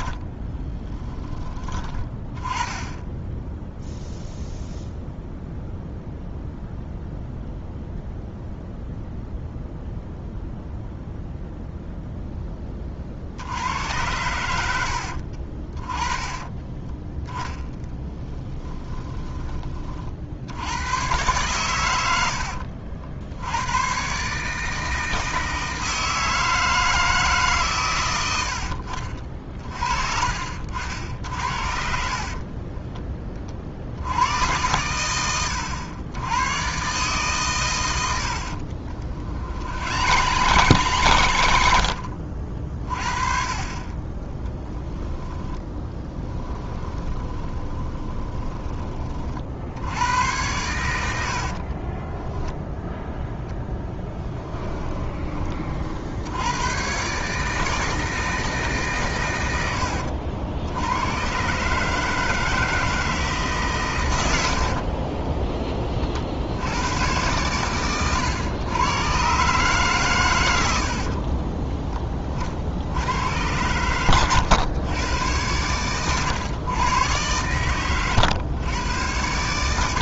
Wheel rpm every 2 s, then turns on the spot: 30, 10, 0, 0, 0, 0, 30, 80, 20, 30, 90, 70, 160, 160, 70, 60, 30, 100, 120, 70, 120, 40, 10, 20, 30, 90, 0, 20, 110, 150, 80, 160, 70, 80, 120, 90, 70, 100, 110, 110.
0-2 18-20 28-30 32-34 38-42 44-48 54-56 64-66 70-72